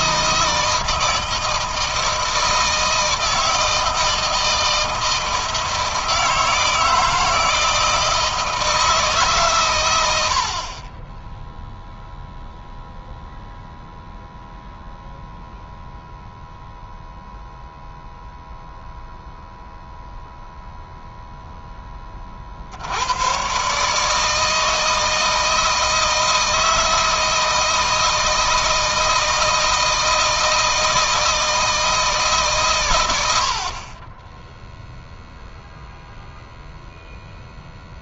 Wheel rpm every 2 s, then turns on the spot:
160, 170, 160, 160, 160, 30, 0, 0, 0, 0, 0, 90, 160, 160, 160, 160, 120, 0, 0.
none